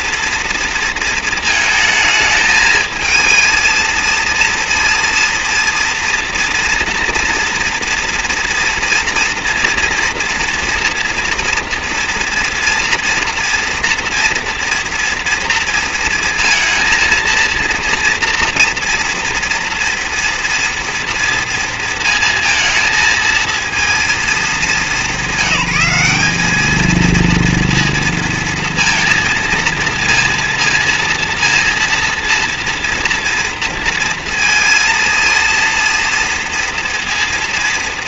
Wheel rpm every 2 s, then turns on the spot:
230, 220, 230, 230, 230, 230, 240, 230, 230, 230, 240, 230, 210, 210, 230, 230, 230, 230, 230.
none